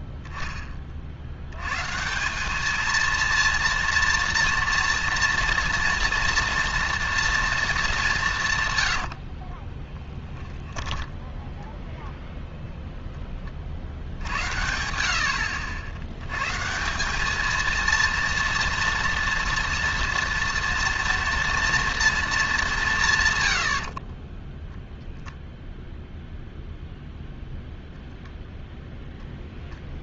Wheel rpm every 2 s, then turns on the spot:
10, 200, 230, 230, 160, 10, 0, 70, 130, 230, 230, 170, 0, 0, 0.
10-12